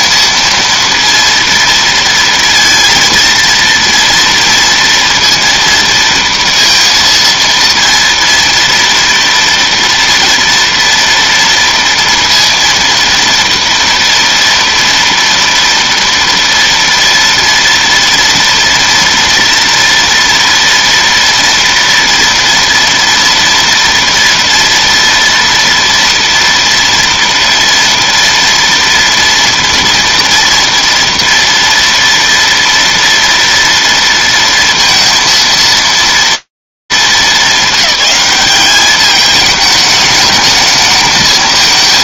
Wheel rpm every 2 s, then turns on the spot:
230, 230, 230, 230, 230, 230, 230, 230, 230, 230, 230, 230, 230, 230, 230, 230, 230, 230, 230, 210, 220.
none